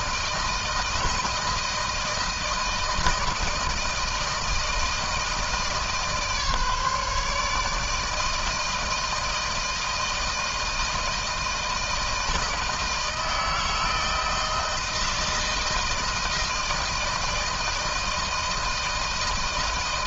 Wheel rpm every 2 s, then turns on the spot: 160, 160, 160, 150, 160, 160, 160, 160, 160, 160.
none